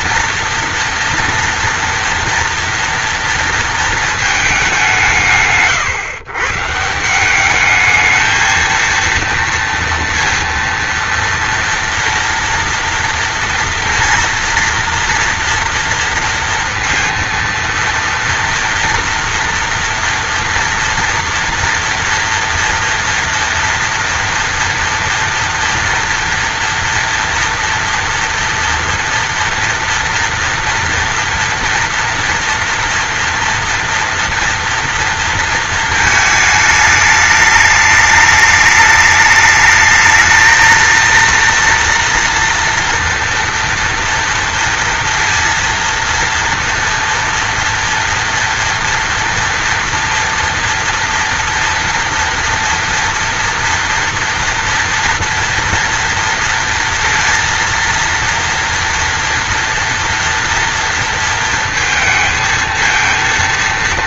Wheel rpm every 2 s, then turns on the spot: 230, 230, 150, 170, 230, 230, 230, 230, 230, 230, 230, 230, 230, 230, 240, 240, 240, 230, 210, 210, 220, 230, 230, 230, 230, 230, 230, 230, 230, 230, 230, 220.
none